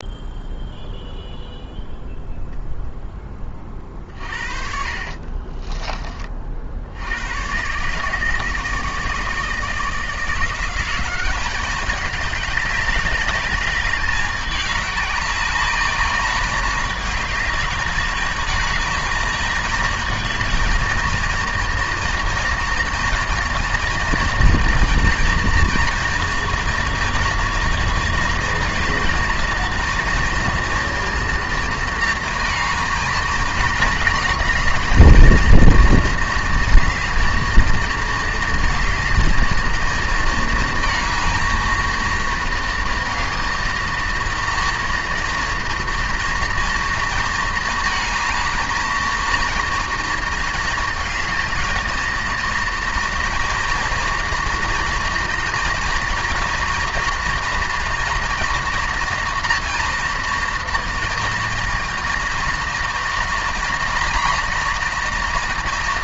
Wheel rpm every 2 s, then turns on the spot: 0, 10, 60, 60, 160, 180, 200, 200, 210, 220, 220, 230, 230, 230, 220, 230, 230, 220, 220, 220, 220, 230, 230, 230, 230, 220, 230, 240, 230, 240, 230, 230, 230.
4-6